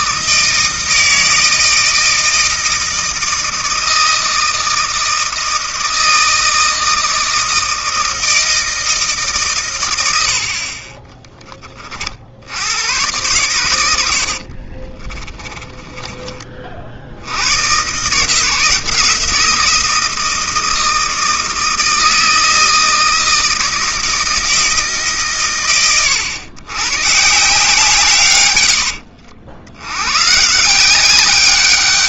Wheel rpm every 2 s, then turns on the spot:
160, 160, 160, 160, 160, 50, 90, 40, 40, 170, 160, 160, 160, 110, 80, 160.
14-16 28-30